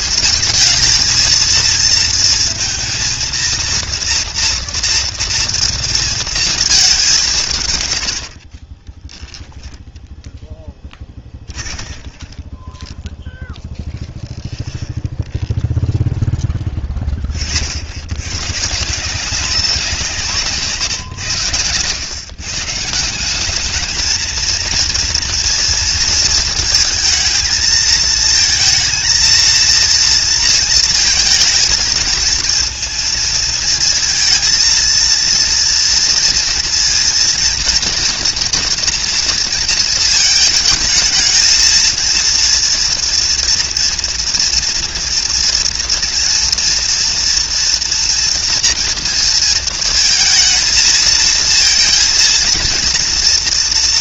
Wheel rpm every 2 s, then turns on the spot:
230, 230, 230, 200, 20, 10, 10, 10, 20, 150, 150, 160, 230, 230, 220, 230, 230, 230, 230, 230, 220, 230, 240, 240, 230, 230, 230.
8-16